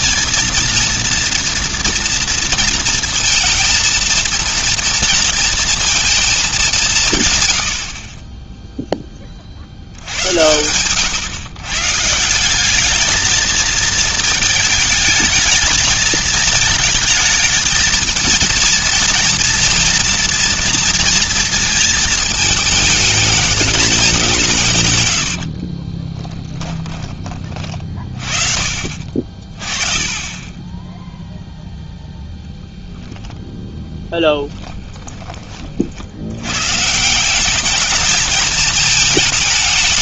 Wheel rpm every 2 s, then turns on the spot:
230, 230, 230, 200, 10, 100, 190, 220, 220, 230, 230, 220, 150, 10, 40, 10, 0, 10, 120, 210.
26-28 34-36